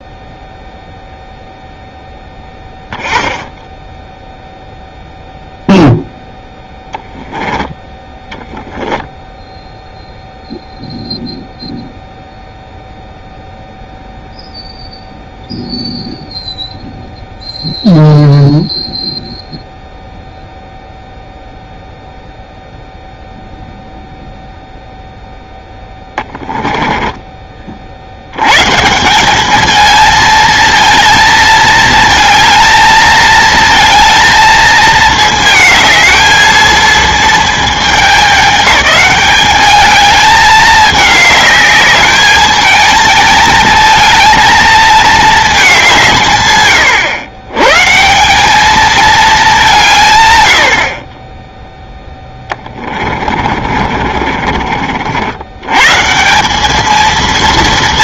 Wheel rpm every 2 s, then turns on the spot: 0, 0, 0, 10, 10, 0, 0, 0, 0, 0, 0, 0, 0, 10, 120, 220, 220, 220, 220, 200, 210, 220, 220, 130, 210, 90, 20, 50, 200.
8-10 26-28 52-54